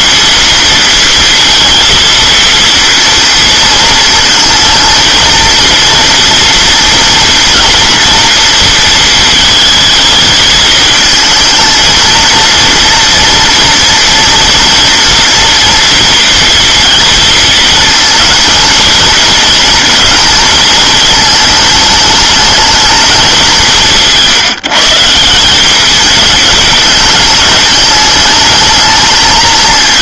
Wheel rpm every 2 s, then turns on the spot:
230, 230, 230, 230, 230, 220, 230, 230, 230, 230, 230, 220, 150, 210, 210.
none